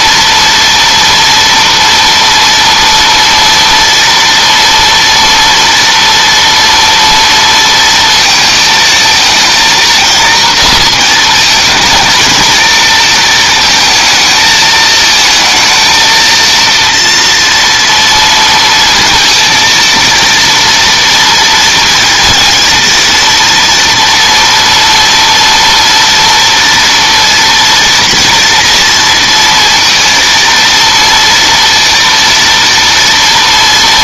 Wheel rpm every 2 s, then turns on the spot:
230, 230, 230, 230, 220, 230, 220, 220, 230, 230, 230, 230, 230, 230, 230, 230, 230.
none